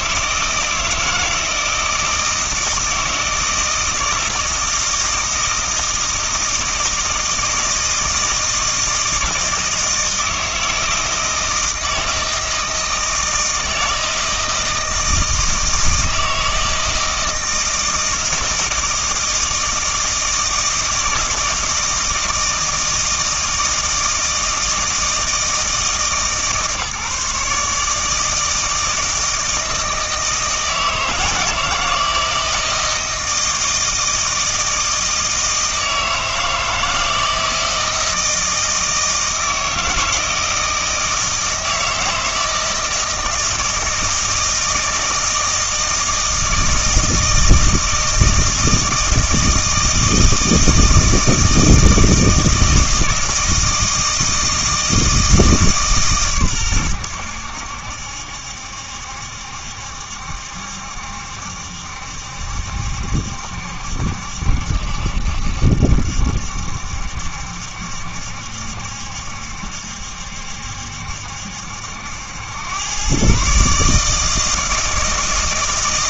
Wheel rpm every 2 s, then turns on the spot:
160, 160, 160, 160, 160, 160, 160, 160, 160, 160, 160, 160, 160, 150, 160, 160, 160, 160, 160, 160, 160, 160, 160, 160, 160, 160, 160, 160, 120, 70, 70, 70, 70, 70, 70, 70, 100, 160.
none